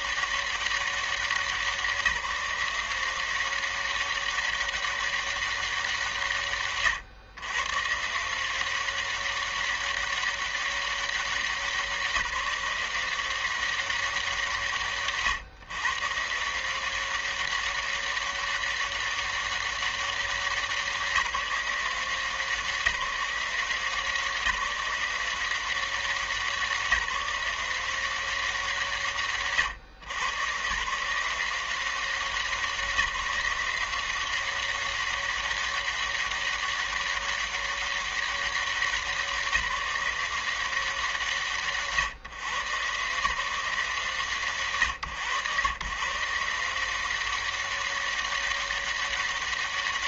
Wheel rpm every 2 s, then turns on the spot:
200, 170, 200, 160, 140, 200, 170, 180, 140, 200, 190, 170, 170, 180, 170, 130, 180, 180, 200, 200, 180, 130, 160, 120, 200.
none